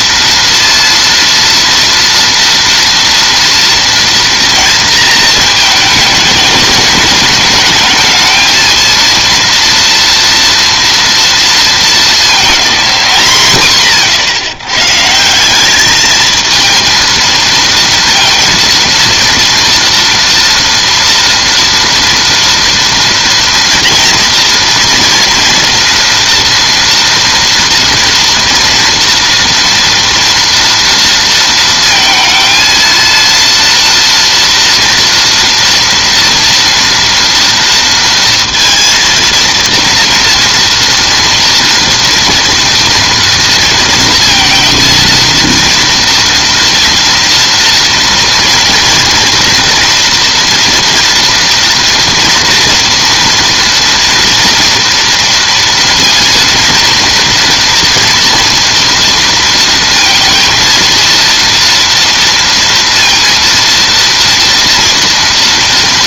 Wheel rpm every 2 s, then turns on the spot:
230, 230, 230, 210, 230, 230, 220, 140, 230, 230, 240, 230, 230, 230, 230, 230, 230, 230, 240, 230, 230, 230, 230, 230, 230, 230, 230, 230, 230, 230, 230, 230, 230.
none